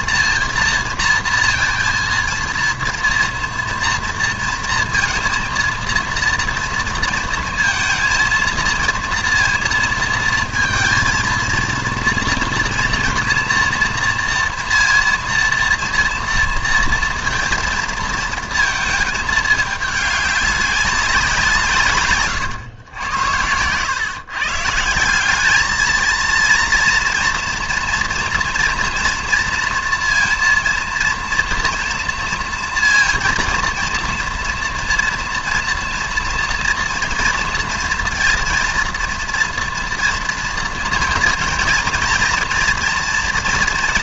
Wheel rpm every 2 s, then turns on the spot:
230, 230, 230, 230, 230, 220, 230, 230, 230, 230, 200, 110, 150, 230, 230, 230, 230, 230, 230, 230, 230, 230.
none